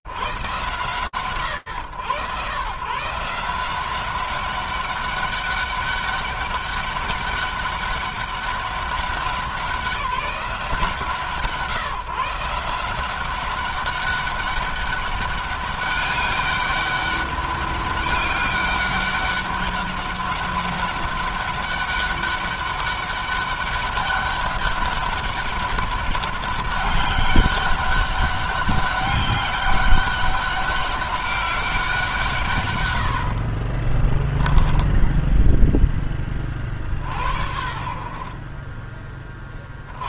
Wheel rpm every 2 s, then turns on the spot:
130, 150, 200, 200, 190, 160, 180, 200, 200, 200, 200, 200, 200, 200, 200, 200, 70, 0, 60, 20.
none